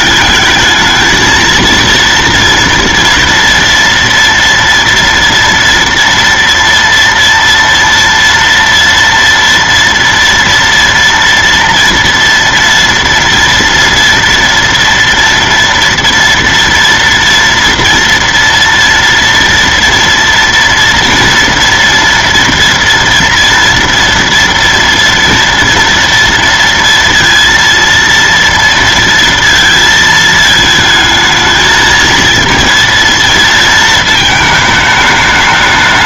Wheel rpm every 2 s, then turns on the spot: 220, 230, 230, 230, 230, 230, 230, 230, 230, 230, 230, 230, 230, 230, 230, 220, 230, 220.
none